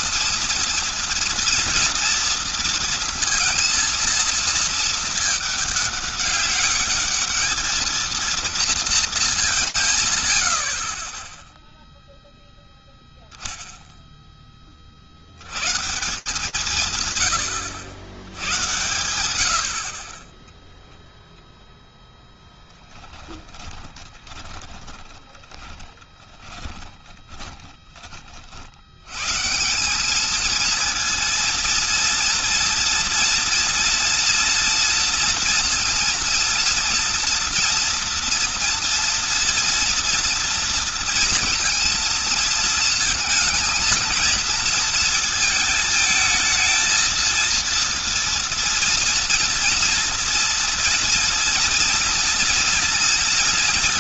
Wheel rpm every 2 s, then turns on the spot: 230, 230, 230, 200, 230, 70, 0, 20, 150, 100, 0, 10, 20, 10, 50, 210, 230, 230, 230, 240, 230, 230, 230, 220, 230, 230, 230.
22-28